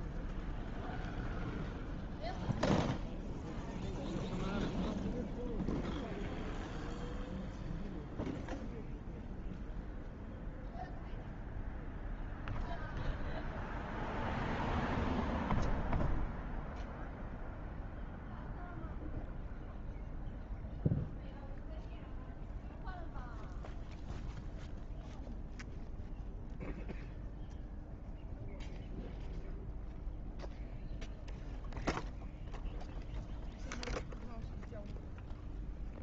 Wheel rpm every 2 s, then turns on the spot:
0, 0, 0, 0, 0, 0, 0, 0, 0, 0, 0, 0, 0, 0, 0, 0, 0, 0.
none